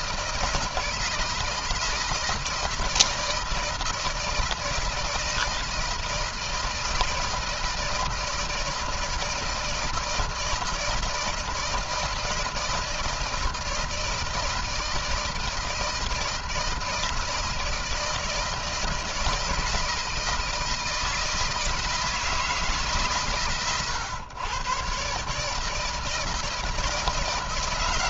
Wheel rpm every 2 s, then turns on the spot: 160, 160, 160, 160, 160, 160, 160, 160, 160, 160, 160, 140, 130, 160.
none